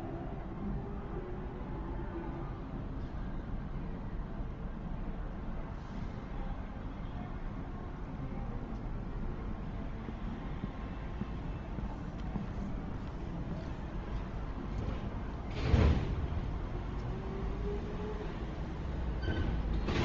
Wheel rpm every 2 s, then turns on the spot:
0, 0, 0, 0, 0, 0, 0, 0, 0, 0.
none